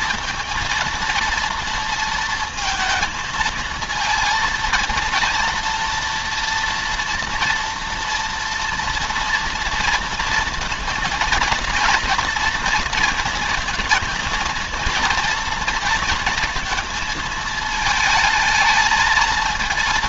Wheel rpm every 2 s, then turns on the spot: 230, 220, 230, 240, 230, 230, 230, 230, 230, 220.
none